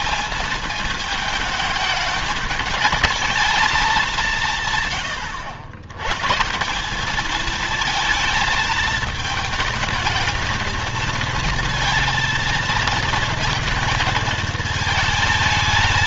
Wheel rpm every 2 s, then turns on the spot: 220, 220, 140, 170, 220, 220, 220, 220.
none